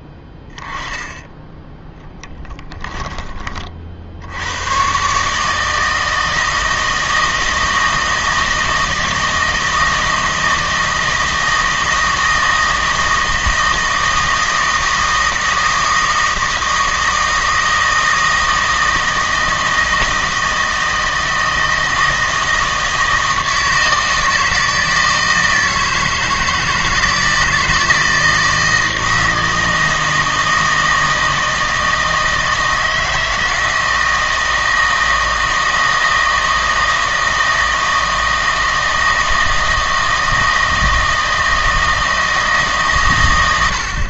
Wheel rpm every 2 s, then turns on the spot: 10, 10, 110, 160, 160, 160, 160, 160, 160, 160, 160, 160, 160, 160, 160, 160, 160, 160, 160, 160, 160, 150.
2-4